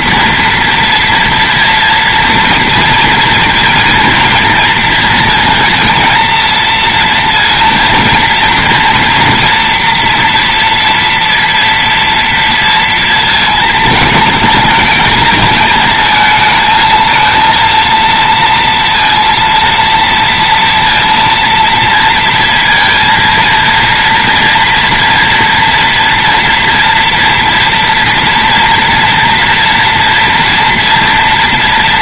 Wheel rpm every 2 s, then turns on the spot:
230, 230, 230, 230, 240, 230, 230, 220, 220, 230, 230, 230, 230, 230, 230, 230.
none